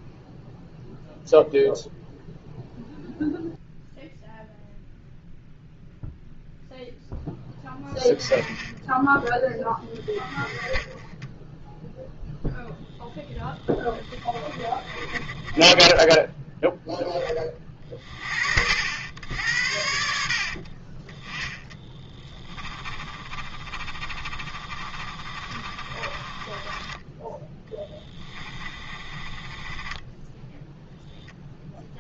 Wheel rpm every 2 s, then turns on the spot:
0, 0, 0, 0, 10, 20, 0, 30, 10, 80, 40, 20, 40, 20, 30, 0.
14-16 20-30